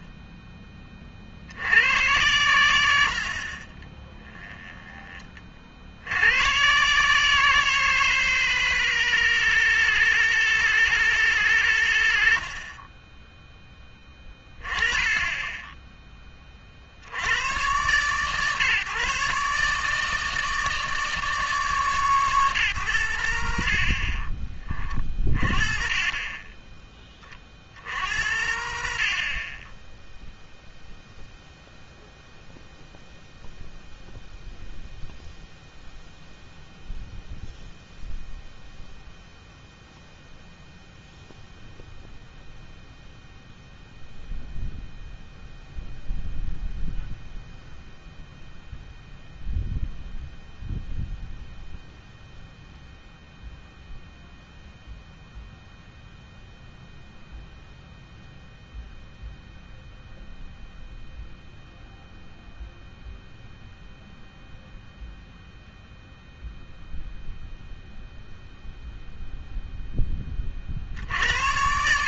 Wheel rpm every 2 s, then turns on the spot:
10, 100, 20, 120, 160, 160, 60, 20, 30, 140, 160, 140, 30, 20, 70, 0, 0, 0, 0, 0, 0, 0, 0, 0, 0, 0, 0, 0, 0, 0, 0, 0, 0, 0, 0, 60.
none